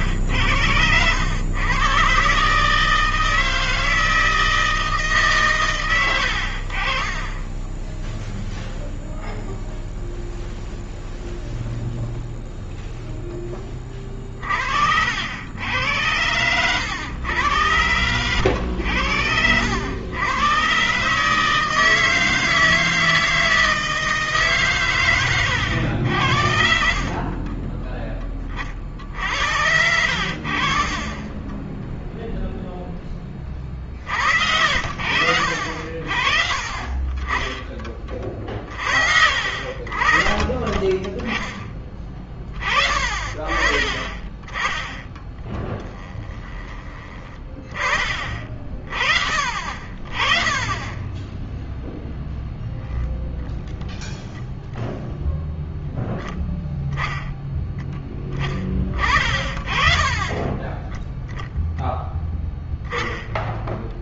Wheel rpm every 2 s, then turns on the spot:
110, 130, 160, 70, 0, 0, 0, 40, 90, 90, 120, 160, 150, 70, 30, 60, 0, 70, 40, 30, 30, 30, 20, 20, 30, 20, 0, 0, 10, 20, 20, 10.
36-38